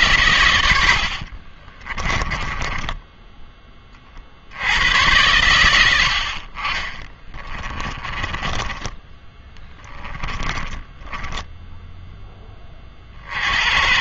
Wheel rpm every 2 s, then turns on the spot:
90, 20, 90, 30, 10, 10, 20.
2-4 6-12